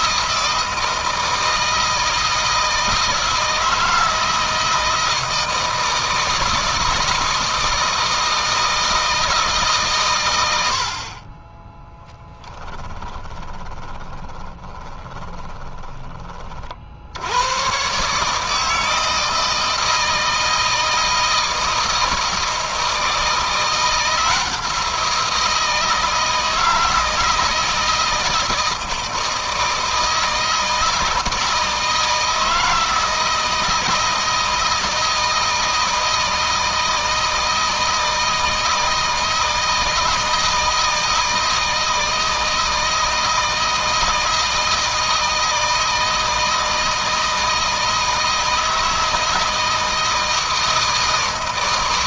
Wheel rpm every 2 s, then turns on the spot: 160, 160, 160, 160, 160, 60, 20, 20, 60, 160, 160, 160, 170, 160, 160, 160, 160, 160, 160, 160, 160, 160, 160, 160, 160, 160.
12-16